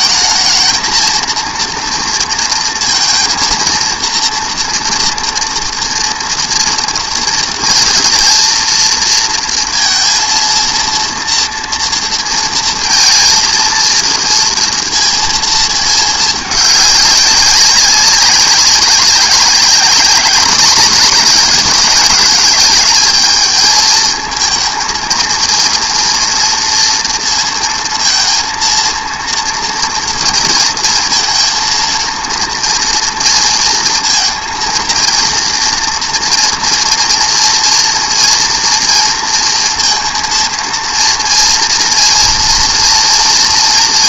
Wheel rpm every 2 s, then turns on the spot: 220, 230, 230, 230, 230, 230, 230, 230, 210, 200, 210, 200, 220, 230, 230, 230, 230, 230, 240, 230, 230, 230.
none